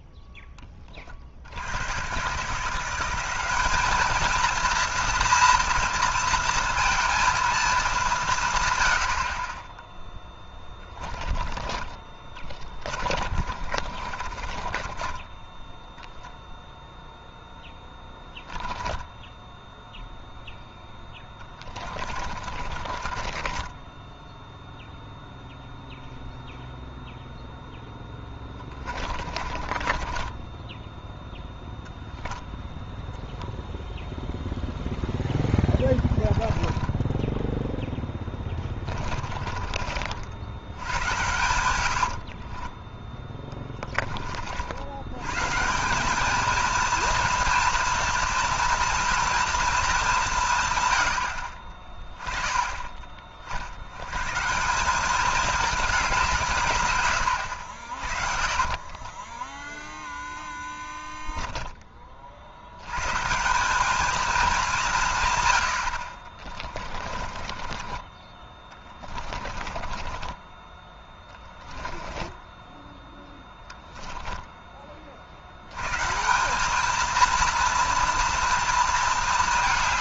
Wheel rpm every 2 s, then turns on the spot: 30, 170, 230, 230, 100, 10, 20, 30, 0, 10, 10, 40, 0, 0, 20, 10, 10, 0, 10, 20, 100, 20, 90, 230, 230, 120, 20, 190, 130, 30, 10, 100, 180, 30, 20, 20, 10, 20, 210, 230.
10-16 18-24 28-30 36-40 42-44 58-62 66-70 72-74